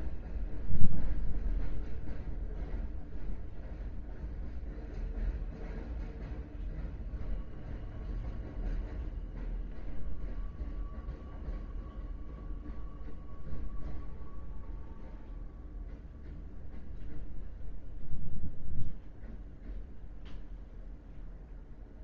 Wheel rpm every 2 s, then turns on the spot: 0, 0, 0, 0, 0, 0, 0, 0, 0, 0, 0.
none